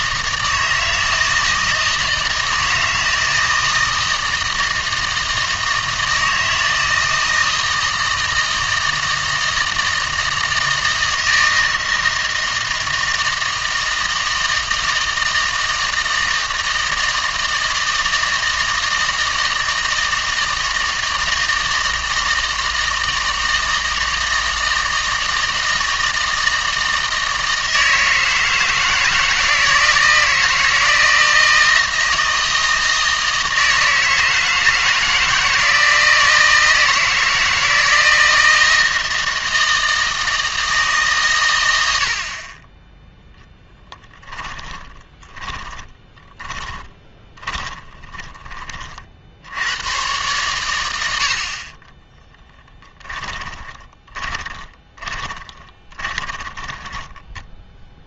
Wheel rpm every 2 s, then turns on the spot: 160, 160, 160, 160, 160, 160, 160, 160, 160, 160, 160, 160, 160, 160, 160, 160, 160, 160, 160, 160, 150, 20, 20, 20, 40, 110, 10, 10, 20.
44-48 54-58